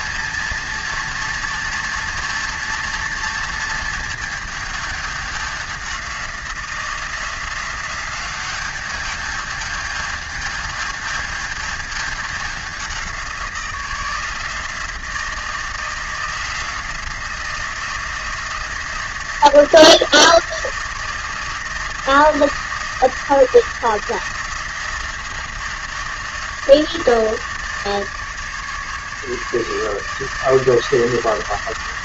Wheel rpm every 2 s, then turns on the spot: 230, 230, 210, 180, 200, 210, 190, 170, 170, 170, 170, 170, 170, 160, 150, 160.
none